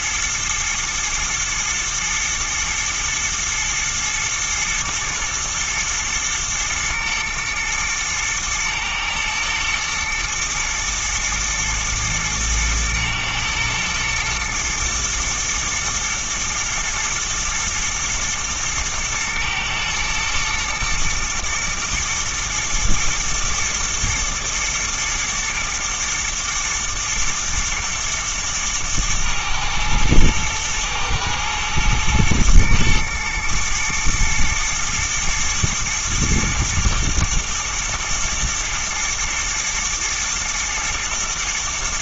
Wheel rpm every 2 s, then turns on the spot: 110, 110, 110, 110, 110, 120, 120, 110, 110, 110, 120, 120, 110, 110, 110, 110, 110, 120, 110, 120, 110.
none